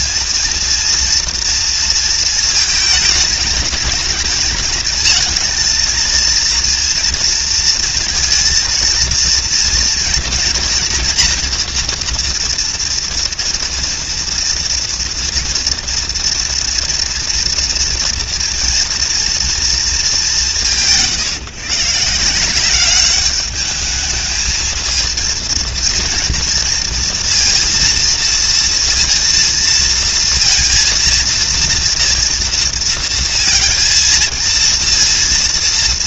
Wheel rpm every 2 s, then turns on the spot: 240, 220, 220, 230, 240, 240, 240, 230, 230, 230, 160, 190, 230, 230, 230, 230, 230, 230.
none